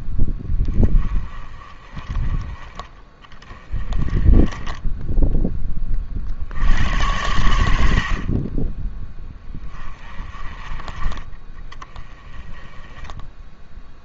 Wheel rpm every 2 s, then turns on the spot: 10, 20, 10, 80, 30, 20, 20.
none